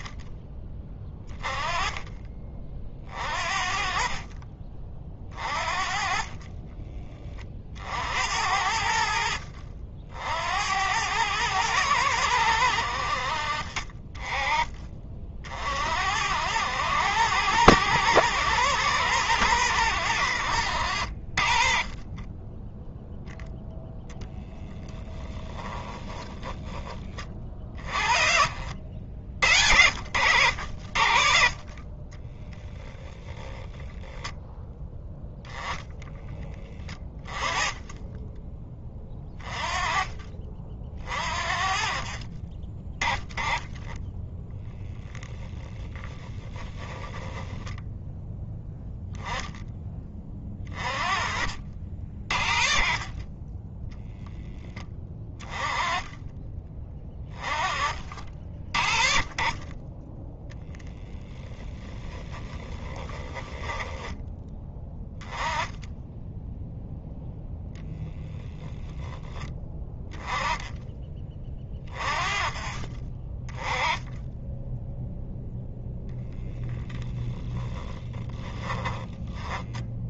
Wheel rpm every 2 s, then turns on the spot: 20, 40, 40, 20, 60, 100, 70, 40, 100, 110, 60, 0, 10, 20, 60, 60, 0, 10, 10, 20, 40, 20, 10, 10, 10, 30, 20, 10, 20, 40, 10, 10, 10, 0, 0, 20, 20, 0, 0, 20.
24-28 36-38 46-48 62-64